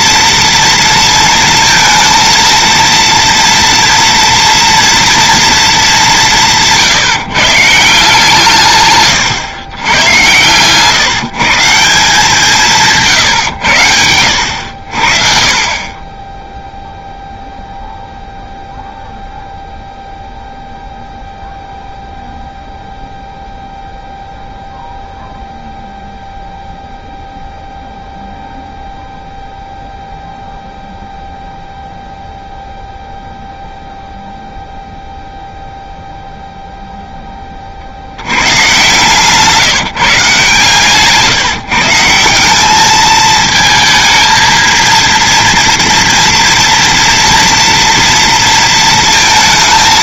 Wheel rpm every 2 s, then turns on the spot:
230, 230, 230, 160, 140, 150, 160, 70, 0, 0, 0, 0, 0, 0, 0, 0, 0, 0, 0, 140, 140, 220, 230, 230, 230.
none